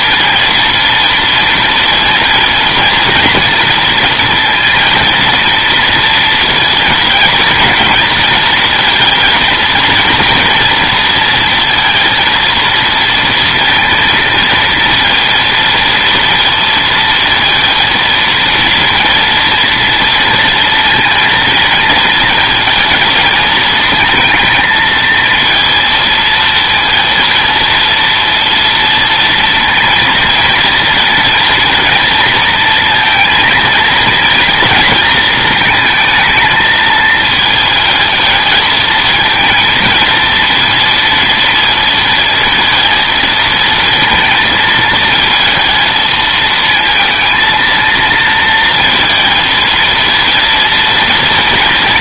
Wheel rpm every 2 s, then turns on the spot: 230, 230, 230, 230, 230, 230, 230, 230, 230, 230, 230, 220, 230, 230, 230, 230, 230, 230, 220, 220, 230, 230, 220, 230, 230, 230.
none